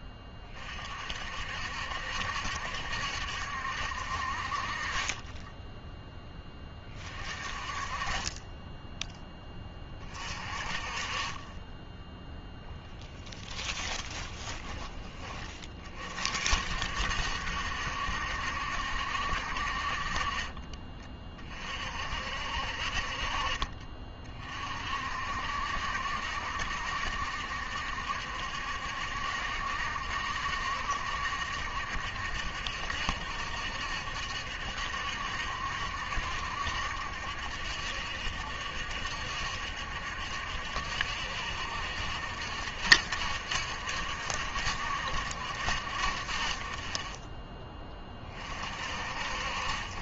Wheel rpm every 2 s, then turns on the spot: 40, 70, 40, 20, 10, 30, 10, 20, 60, 70, 30, 50, 50, 60, 70, 70, 70, 70, 70, 70, 70, 70, 60, 30, 40.
8-10 12-16